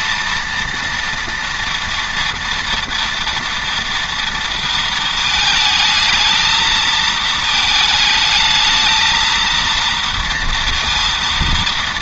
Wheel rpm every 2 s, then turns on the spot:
230, 230, 220, 220, 220, 230.
none